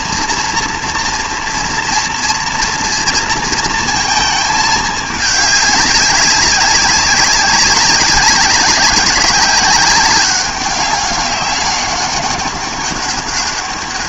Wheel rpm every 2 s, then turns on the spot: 230, 230, 210, 190, 200, 190, 200.
none